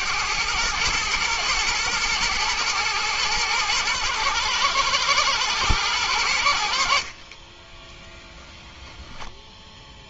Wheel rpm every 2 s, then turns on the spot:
110, 110, 110, 30, 30.
6-8